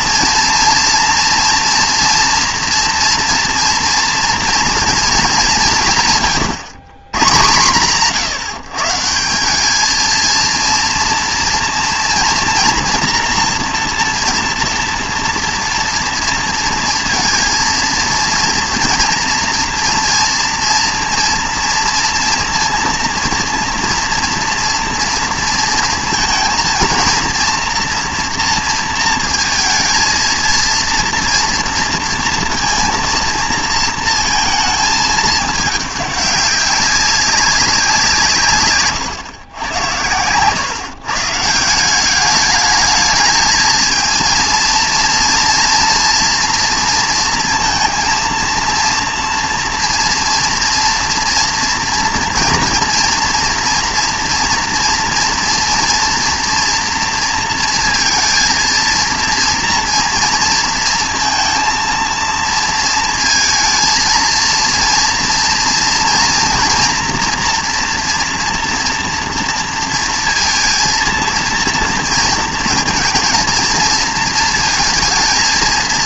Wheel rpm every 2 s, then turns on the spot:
230, 240, 240, 120, 150, 230, 230, 230, 230, 230, 230, 230, 230, 230, 230, 230, 230, 220, 200, 130, 120, 210, 230, 230, 230, 230, 230, 230, 230, 230, 230, 230, 230, 230, 230, 230, 230, 230.
38-40